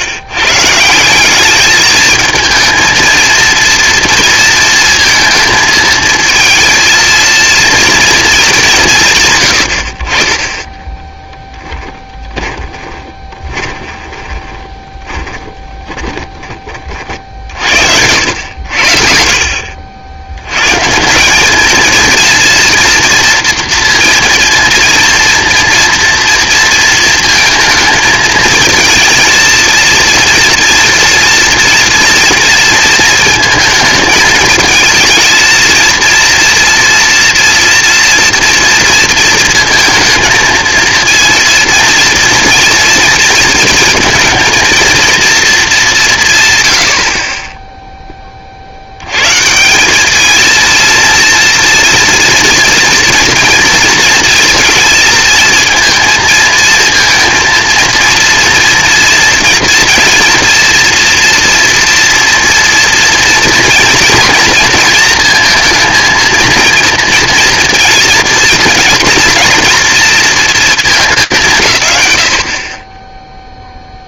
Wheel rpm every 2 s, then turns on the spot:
150, 220, 230, 230, 170, 10, 20, 20, 30, 80, 120, 230, 230, 230, 220, 230, 230, 220, 230, 230, 230, 230, 230, 120, 50, 220, 230, 230, 230, 230, 230, 230, 230, 230, 230, 230, 90.
10-16